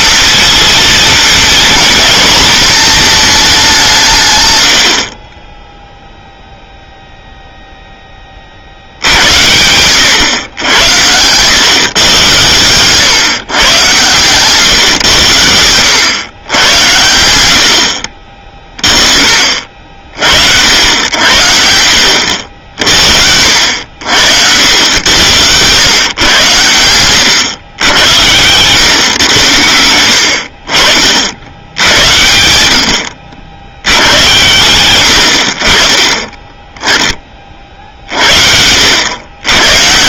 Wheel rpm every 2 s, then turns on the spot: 230, 230, 90, 0, 60, 100, 130, 130, 110, 30, 70, 60, 90, 110, 110, 50, 80, 100, 10, 80.
none